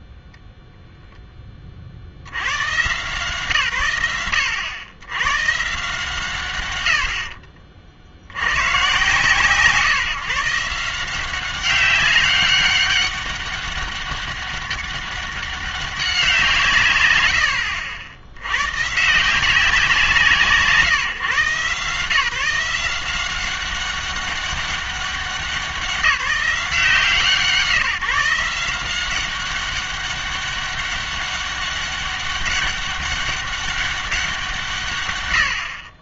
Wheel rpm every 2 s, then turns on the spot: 0, 120, 90, 80, 120, 150, 200, 200, 150, 100, 160, 170, 200, 180, 170, 200, 200, 150.
none